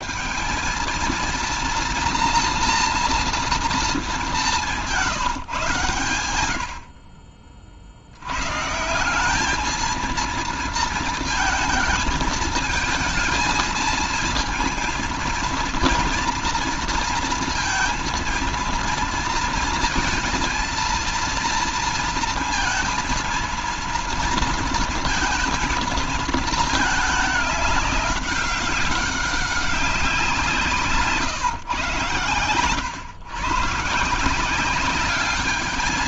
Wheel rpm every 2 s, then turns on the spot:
230, 240, 160, 50, 190, 230, 230, 230, 230, 230, 230, 230, 230, 210, 190, 140, 130, 210.
none